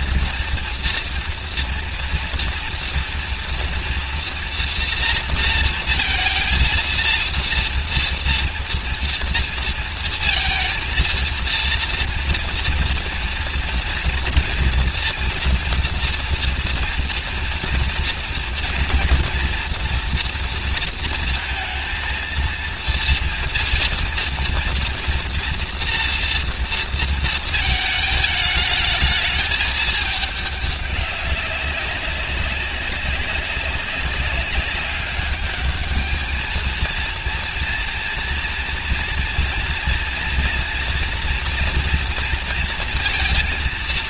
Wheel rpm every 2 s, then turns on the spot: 230, 230, 240, 230, 230, 230, 230, 230, 230, 230, 230, 230, 230, 230, 210, 200, 190, 200, 220, 230, 230, 230.
none